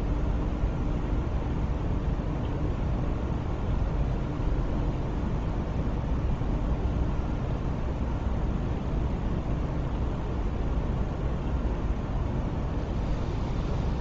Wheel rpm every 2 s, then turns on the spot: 0, 0, 0, 0, 0, 0, 0.
none